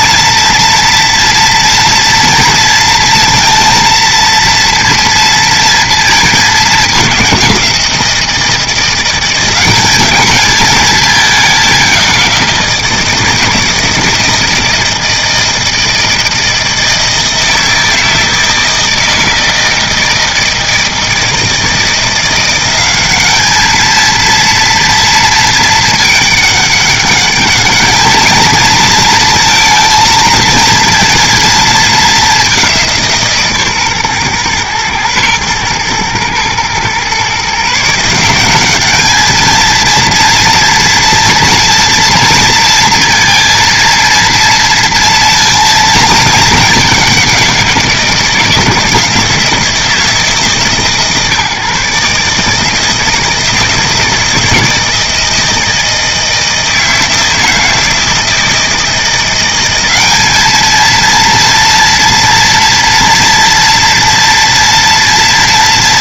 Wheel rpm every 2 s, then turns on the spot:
230, 230, 230, 200, 170, 220, 170, 160, 160, 160, 160, 190, 230, 200, 220, 230, 190, 120, 120, 200, 230, 230, 230, 210, 170, 140, 160, 160, 160, 170, 220, 230, 230.
none